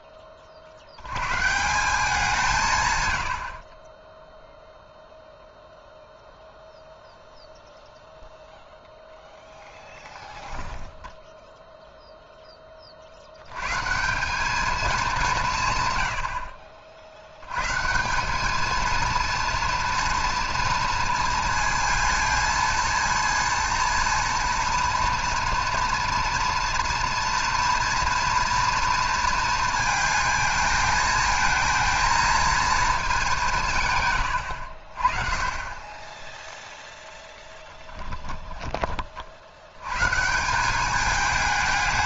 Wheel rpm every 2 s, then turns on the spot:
70, 90, 0, 0, 0, 10, 20, 210, 50, 220, 230, 230, 230, 230, 230, 220, 220, 60, 0, 20, 180.
38-40